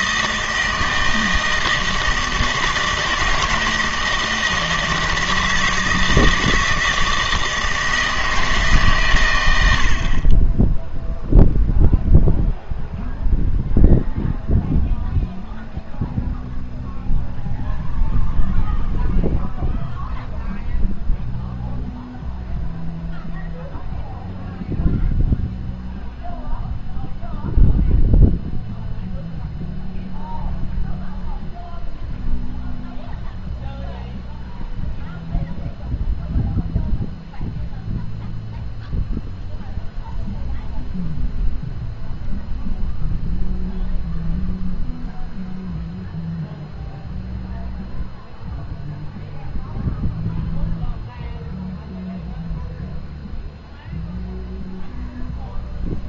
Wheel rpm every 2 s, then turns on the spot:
160, 160, 160, 160, 150, 20, 0, 0, 0, 0, 0, 0, 0, 0, 0, 0, 0, 0, 0, 0, 0, 0, 0, 0, 0, 0, 0, 0.
none